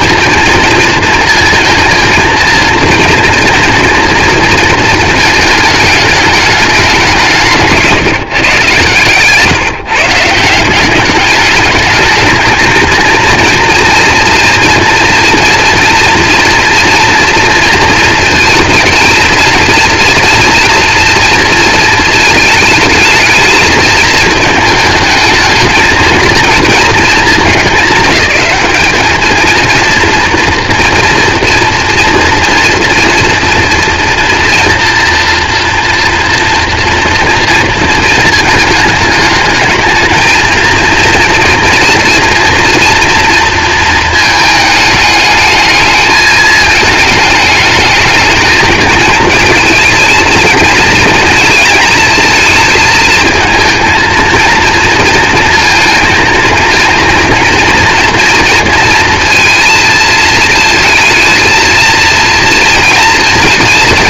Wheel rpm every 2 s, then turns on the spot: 220, 230, 230, 210, 140, 180, 230, 230, 230, 230, 230, 220, 220, 230, 210, 230, 230, 230, 230, 220, 230, 230, 210, 210, 220, 220, 220, 230, 230, 230, 220, 230.
none